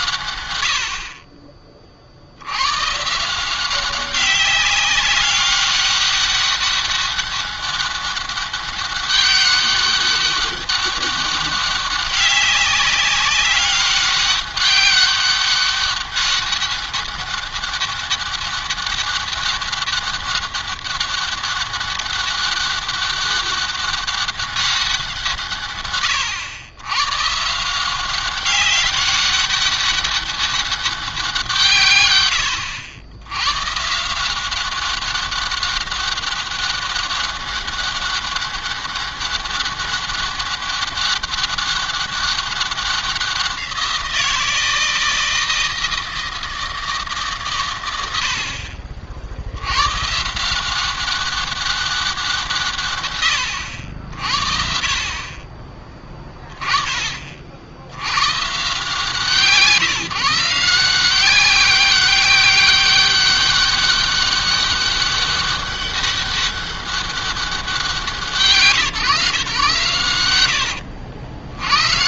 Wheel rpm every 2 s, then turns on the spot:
60, 130, 200, 200, 200, 200, 190, 200, 190, 200, 200, 200, 180, 130, 190, 190, 90, 190, 200, 200, 200, 190, 160, 160, 60, 180, 140, 50, 30, 160, 170, 200, 200, 200, 150, 80.
none